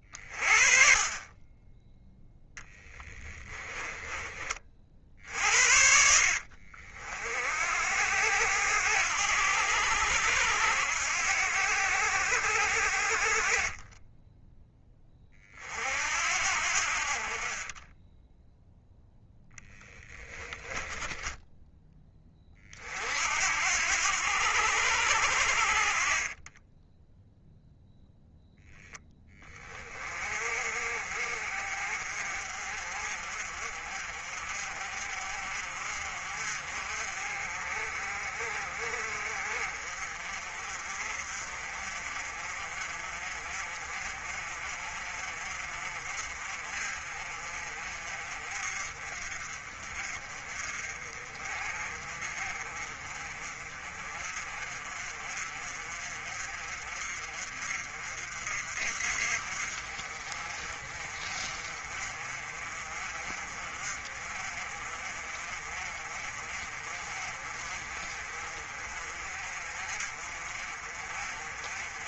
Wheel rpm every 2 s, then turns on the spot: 30, 10, 40, 50, 80, 80, 60, 10, 60, 10, 20, 40, 80, 10, 10, 50, 50, 50, 50, 40, 40, 40, 40, 40, 40, 40, 40, 40, 40, 50, 40, 40, 40, 40, 40, 40.
2-4 20-22 26-28